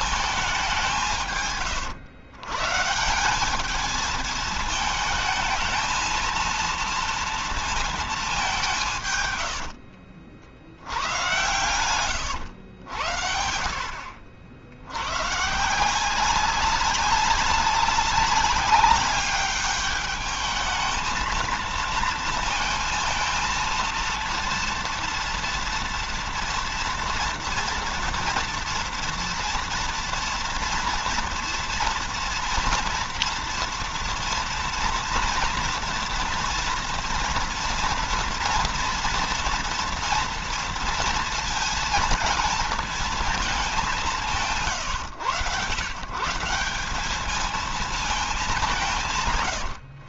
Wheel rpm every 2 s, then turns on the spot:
170, 160, 220, 230, 160, 100, 90, 90, 190, 200, 220, 230, 230, 240, 230, 230, 230, 230, 230, 230, 230, 220, 130, 200, 180.
10-12